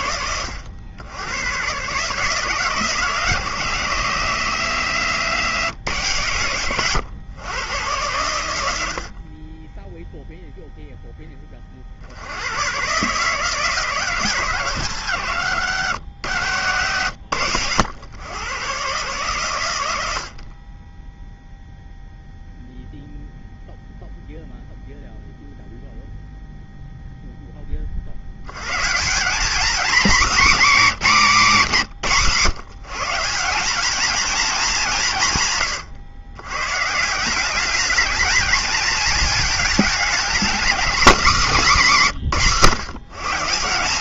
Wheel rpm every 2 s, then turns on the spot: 160, 160, 120, 80, 0, 100, 140, 110, 130, 30, 0, 0, 0, 60, 230, 150, 220, 120, 220, 240, 180, 220.
none